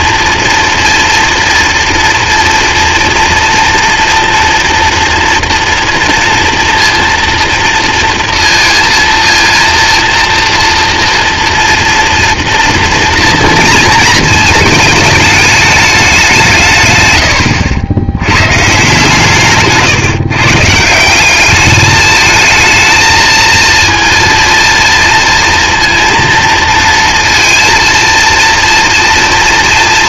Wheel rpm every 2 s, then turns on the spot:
230, 230, 230, 230, 230, 230, 230, 220, 150, 130, 150, 220, 230, 230, 230.
none